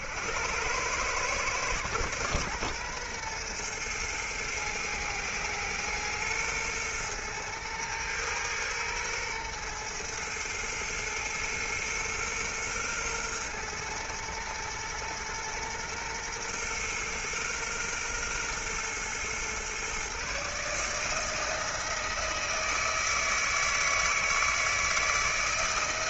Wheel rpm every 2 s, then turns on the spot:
110, 120, 110, 120, 110, 110, 120, 120, 120, 120, 160, 160, 160.
none